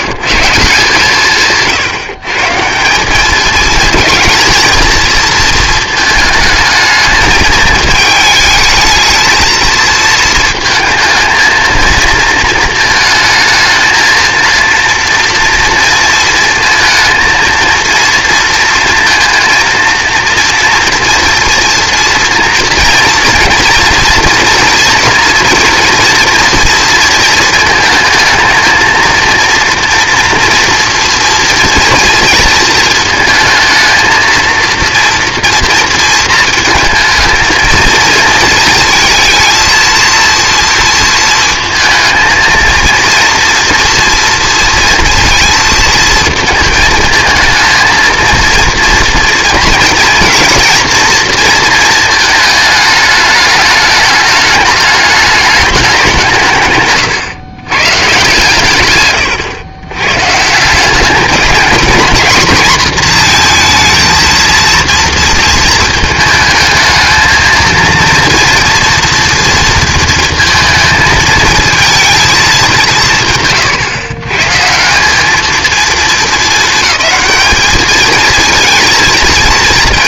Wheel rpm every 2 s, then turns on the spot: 160, 160, 230, 220, 220, 220, 220, 230, 230, 230, 230, 230, 230, 230, 220, 240, 230, 230, 220, 220, 230, 230, 230, 220, 230, 230, 220, 210, 150, 130, 170, 240, 230, 220, 230, 220, 210, 150, 220, 220.
none